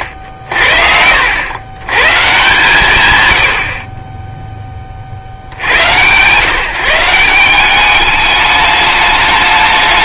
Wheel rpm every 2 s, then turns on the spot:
70, 170, 10, 150, 210.
none